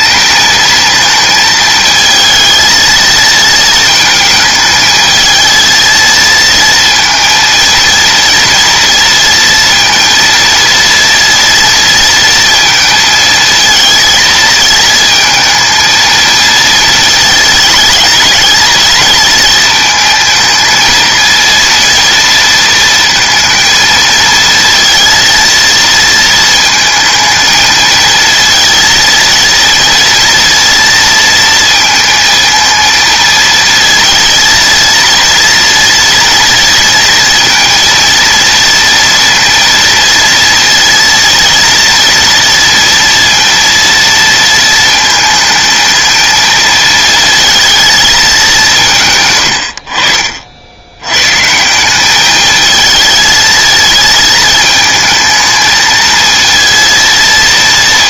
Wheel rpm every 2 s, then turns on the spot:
220, 230, 220, 230, 230, 230, 220, 220, 230, 220, 230, 230, 230, 220, 230, 230, 230, 230, 230, 230, 230, 230, 230, 220, 170, 80, 220, 220, 230.
none